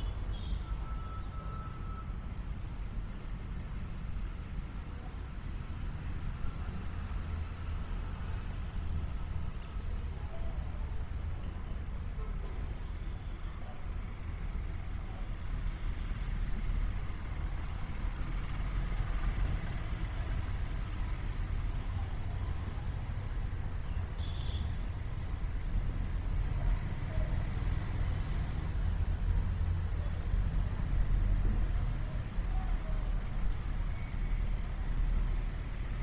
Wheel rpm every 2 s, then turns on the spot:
0, 0, 0, 0, 0, 0, 0, 0, 0, 0, 0, 0, 0, 0, 0, 0, 0, 0.
none